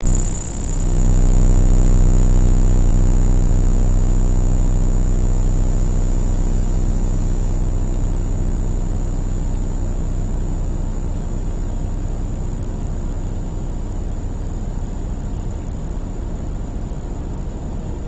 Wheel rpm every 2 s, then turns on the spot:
0, 0, 0, 0, 0, 0, 0, 0, 0.
none